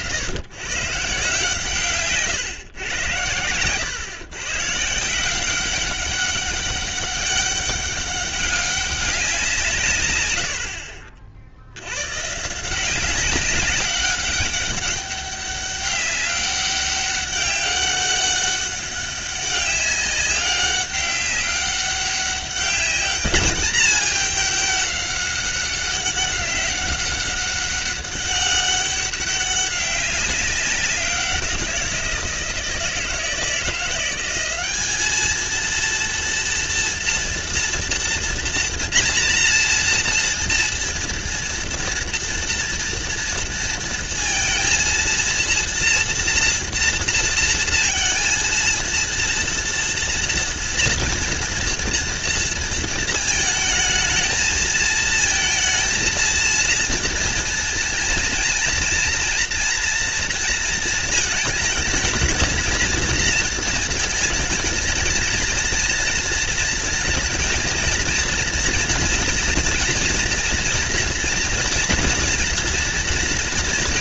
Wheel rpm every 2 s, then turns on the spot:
140, 120, 160, 200, 190, 60, 180, 200, 200, 200, 200, 200, 200, 200, 200, 180, 160, 210, 230, 240, 230, 230, 230, 230, 230, 230, 230, 220, 230, 230, 230, 230, 220, 230, 240, 240, 240.
none